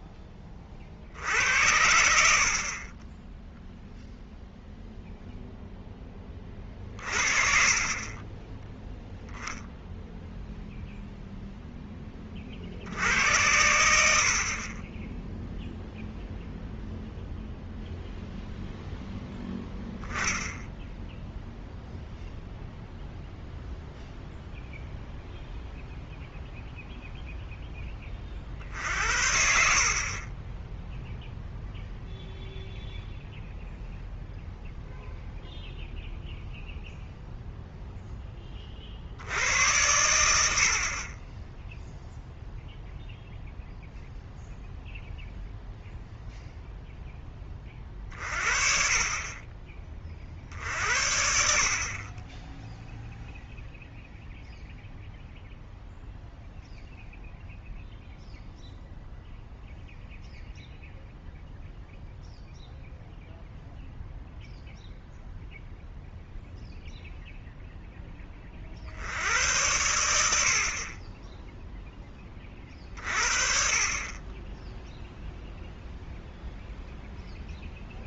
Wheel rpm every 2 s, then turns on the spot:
30, 50, 0, 30, 10, 0, 50, 40, 0, 0, 0, 0, 0, 0, 50, 20, 0, 0, 0, 30, 60, 0, 0, 0, 40, 50, 10, 0, 0, 0, 0, 0, 0, 0, 50, 50, 30, 10, 0.
none